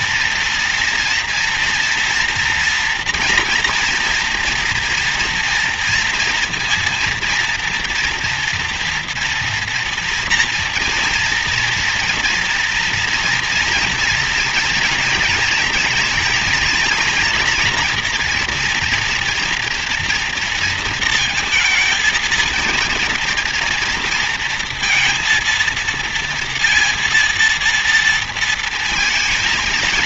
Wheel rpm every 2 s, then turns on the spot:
230, 230, 230, 230, 230, 230, 230, 230, 230, 240, 230, 230, 230, 230, 230.
none